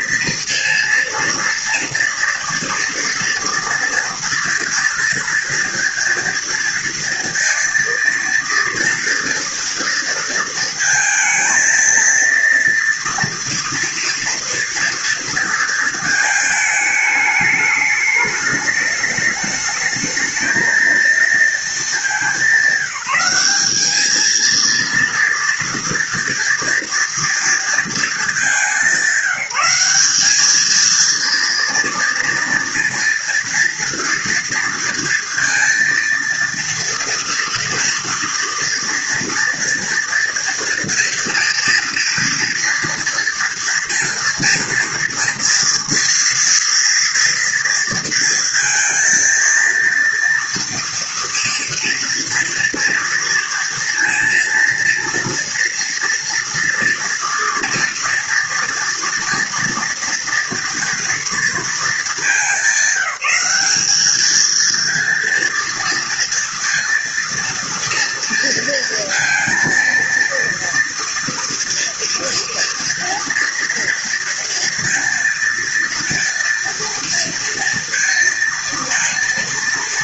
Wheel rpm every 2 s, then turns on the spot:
230, 230, 230, 230, 240, 230, 230, 230, 210, 210, 230, 190, 230, 240, 180, 220, 230, 230, 230, 230, 240, 230, 230, 230, 230, 230, 230, 230, 230, 230, 230, 200, 230, 230, 230, 230, 230, 230, 230, 220.
none